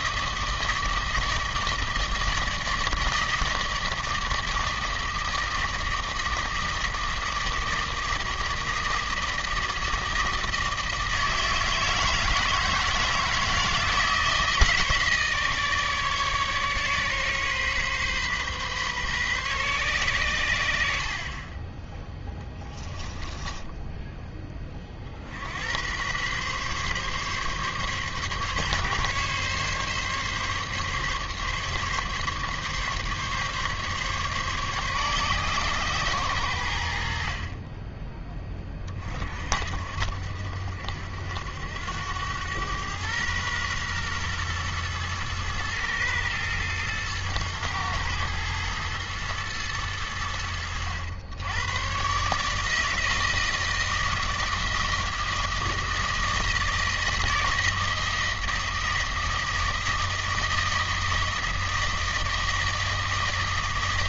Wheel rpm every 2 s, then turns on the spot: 160, 160, 160, 160, 160, 160, 160, 160, 140, 130, 60, 10, 30, 140, 140, 140, 140, 130, 70, 30, 70, 110, 110, 110, 110, 90, 160, 160, 160, 160, 160, 160.
22-24